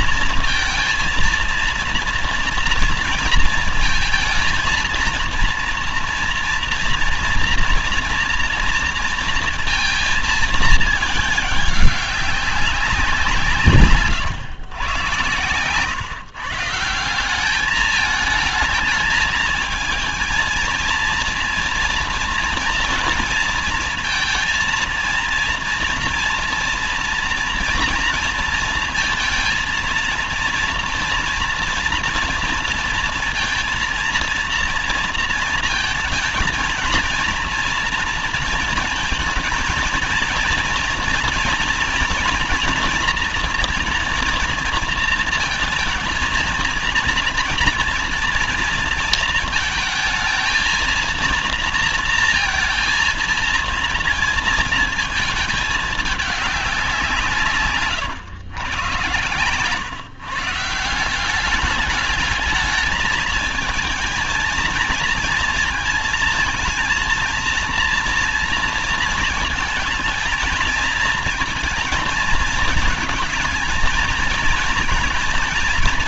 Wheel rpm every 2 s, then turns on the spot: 230, 230, 230, 240, 230, 220, 190, 120, 150, 220, 230, 230, 230, 240, 230, 230, 230, 230, 230, 230, 230, 240, 240, 230, 230, 230, 230, 230, 200, 110, 150, 210, 230, 230, 230, 230, 220, 230.
none